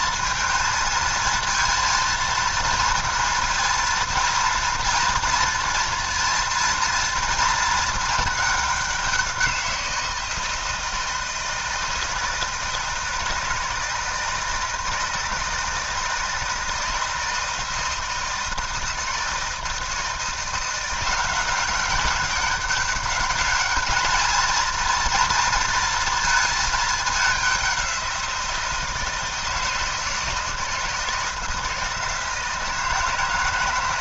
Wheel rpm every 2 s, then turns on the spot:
220, 230, 240, 240, 200, 160, 160, 160, 160, 160, 170, 200, 220, 220, 170, 160, 160.
none